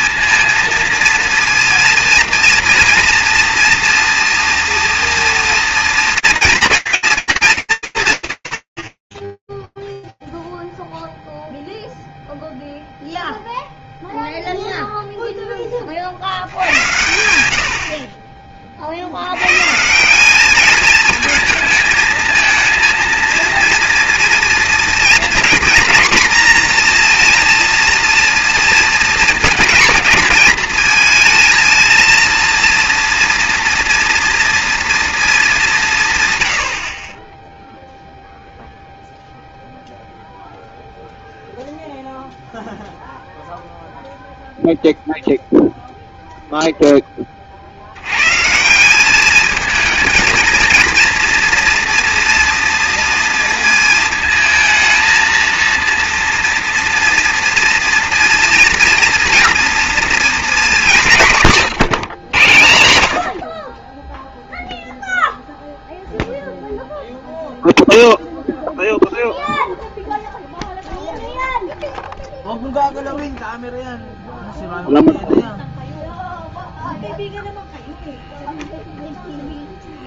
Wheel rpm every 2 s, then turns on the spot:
230, 240, 240, 230, 100, 0, 0, 0, 80, 60, 220, 230, 230, 240, 230, 230, 230, 230, 40, 0, 0, 0, 0, 30, 210, 230, 230, 220, 230, 230, 180, 70, 0, 0, 0, 0, 0, 0, 0, 0.
none